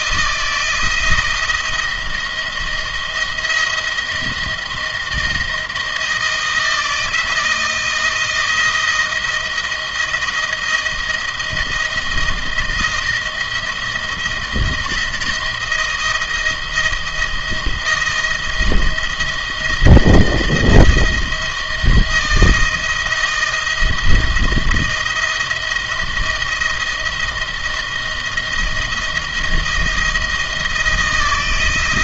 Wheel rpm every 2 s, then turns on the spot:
160, 170, 160, 160, 170, 160, 160, 160, 160, 160, 160, 160, 160, 160, 160, 160.
none